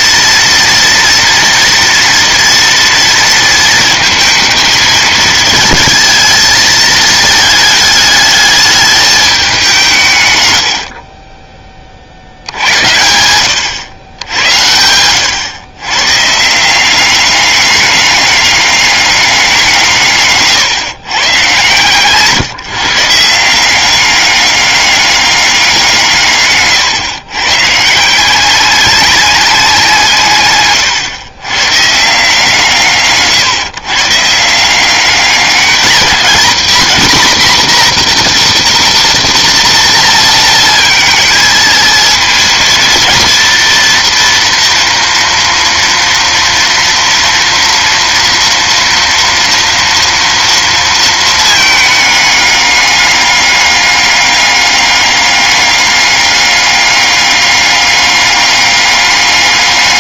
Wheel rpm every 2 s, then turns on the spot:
230, 230, 220, 220, 210, 90, 80, 90, 160, 200, 140, 150, 200, 130, 190, 130, 160, 170, 230, 240, 230, 230, 230, 230, 240, 230, 210, 200, 200, 200.
none